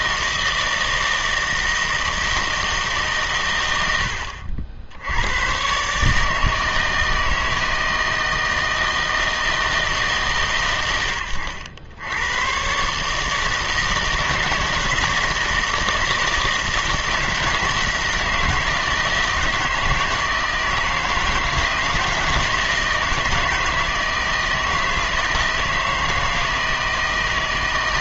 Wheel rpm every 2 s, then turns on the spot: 160, 150, 70, 160, 160, 110, 130, 160, 160, 160, 160, 160, 160, 160.
none